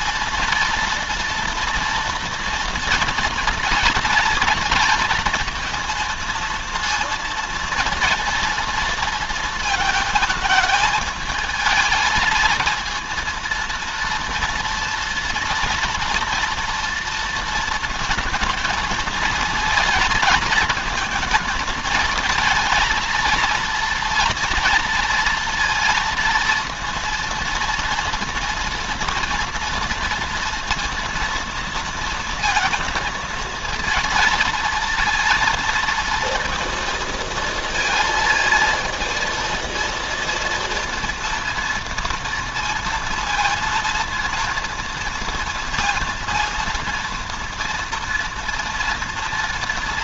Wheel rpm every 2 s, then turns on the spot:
230, 230, 230, 230, 230, 220, 230, 240, 230, 230, 220, 230, 230, 230, 230, 230, 230, 230, 230, 230, 230, 230, 230, 230, 230.
none